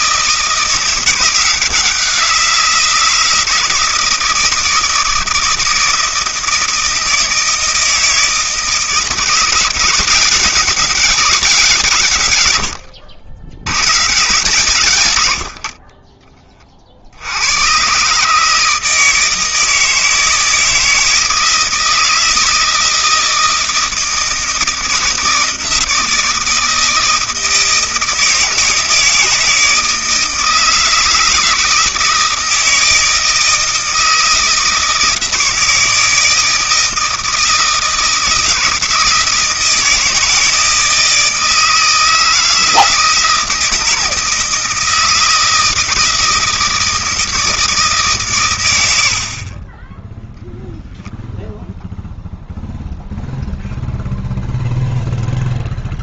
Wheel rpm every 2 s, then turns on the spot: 170, 170, 160, 160, 160, 180, 90, 140, 30, 160, 160, 160, 160, 160, 160, 160, 160, 160, 160, 160, 160, 160, 160, 160, 100, 0, 0, 0.
12-14